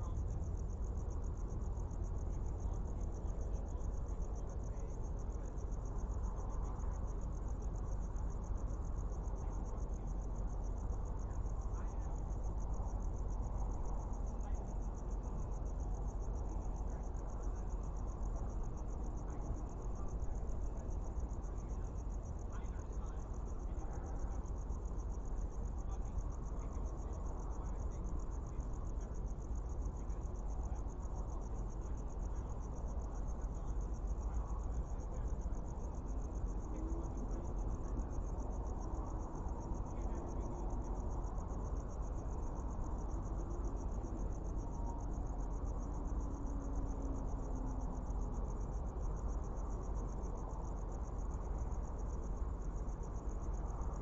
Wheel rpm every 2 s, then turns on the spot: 0, 0, 0, 0, 0, 0, 0, 0, 0, 0, 0, 0, 0, 0, 0, 0, 0, 0, 0, 0, 0, 0, 0, 0, 0, 0, 0.
none